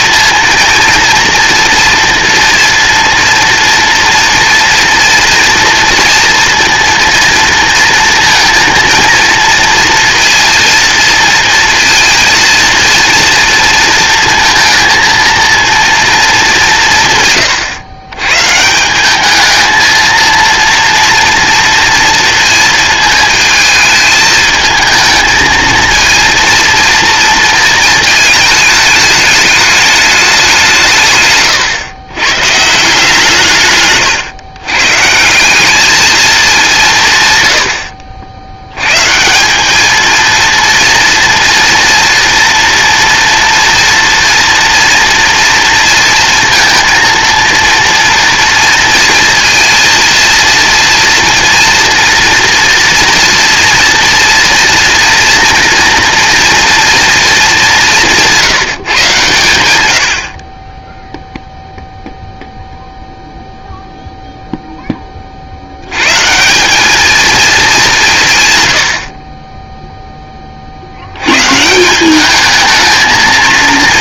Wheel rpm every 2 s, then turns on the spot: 230, 230, 230, 230, 230, 230, 230, 230, 140, 210, 230, 220, 220, 230, 220, 140, 160, 150, 130, 150, 230, 240, 230, 230, 230, 230, 240, 230, 230, 140, 0, 0, 20, 210, 90, 60, 220.
none